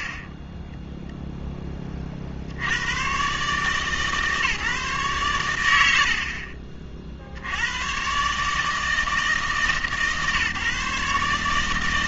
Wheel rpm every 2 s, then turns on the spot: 30, 70, 150, 60, 150, 140.
none